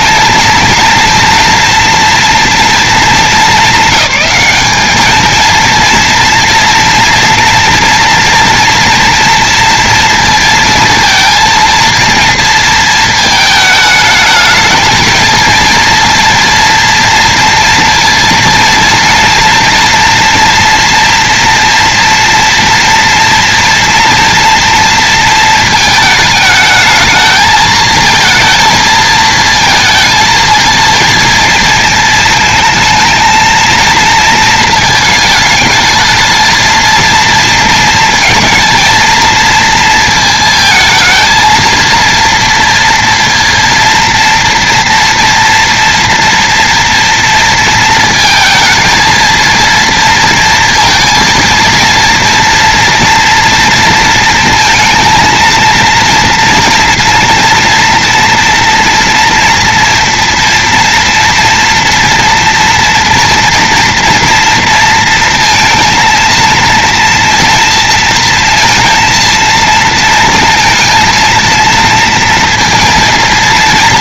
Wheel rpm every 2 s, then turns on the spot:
230, 230, 210, 230, 230, 230, 230, 220, 230, 230, 230, 230, 230, 220, 220, 220, 220, 220, 230, 230, 220, 230, 230, 230, 230, 230, 230, 230, 230, 230, 240, 230, 230, 230, 230, 230, 230.
none